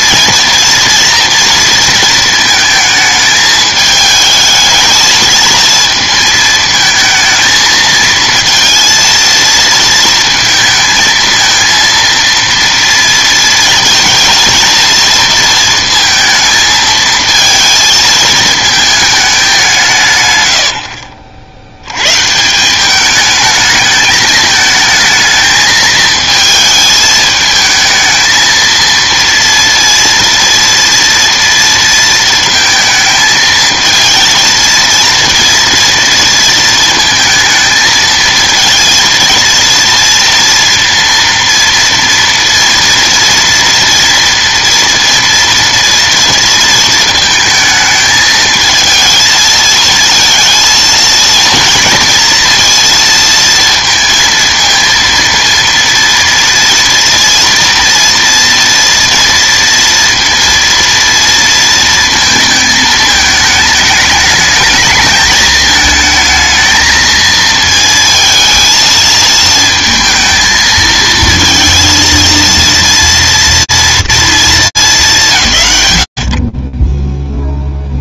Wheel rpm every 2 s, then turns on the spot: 240, 220, 220, 220, 230, 220, 230, 230, 220, 220, 100, 170, 220, 220, 220, 230, 230, 230, 230, 230, 230, 230, 230, 230, 220, 230, 230, 230, 230, 230, 230, 220, 220, 220, 220, 220, 230, 200, 20.
none